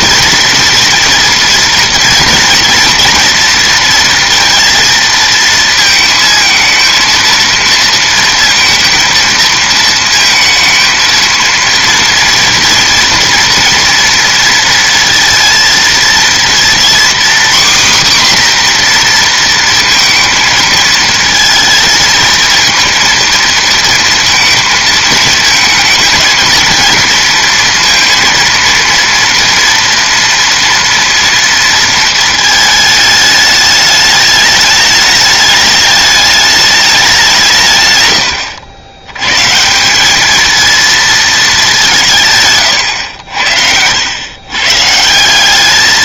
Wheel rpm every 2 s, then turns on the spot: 230, 230, 230, 230, 230, 230, 230, 230, 240, 250, 220, 230, 220, 230, 230, 230, 220, 210, 210, 90, 230, 130, 150.
none